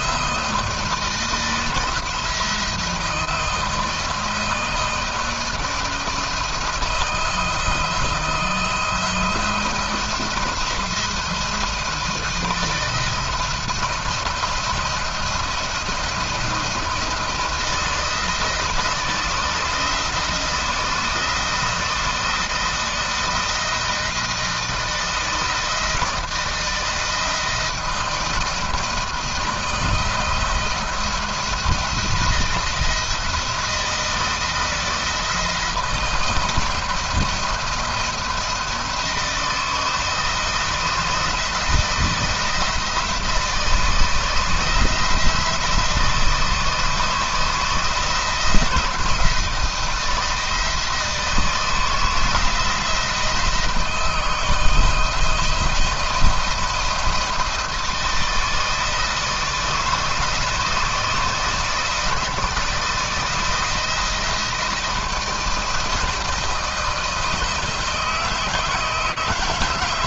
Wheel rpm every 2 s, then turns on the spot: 160, 160, 160, 170, 170, 170, 160, 170, 170, 160, 170, 170, 160, 160, 160, 170, 160, 170, 170, 170, 160, 170, 160, 160, 160, 160, 160, 170, 170, 160, 160, 160, 170, 160, 160.
none